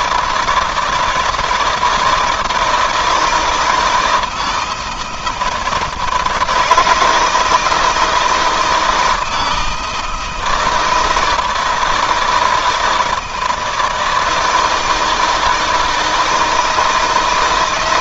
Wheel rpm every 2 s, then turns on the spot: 160, 160, 160, 160, 170, 160, 160, 160, 160.
none